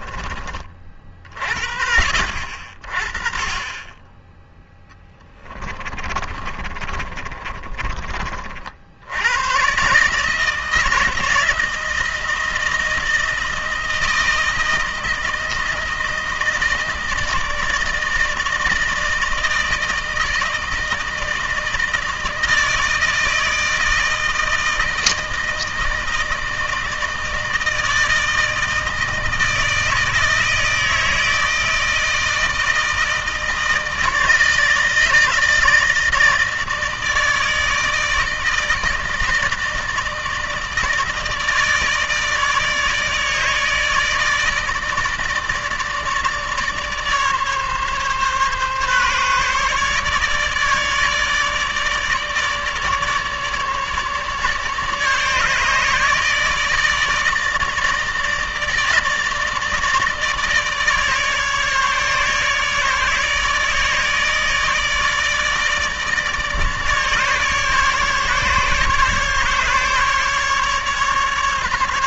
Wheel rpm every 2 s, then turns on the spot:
40, 40, 10, 30, 80, 160, 160, 160, 160, 160, 160, 160, 160, 160, 160, 160, 160, 160, 160, 160, 150, 150, 160, 150, 140, 150, 150, 150, 160, 150, 150, 150, 160, 150, 140, 140.
4-8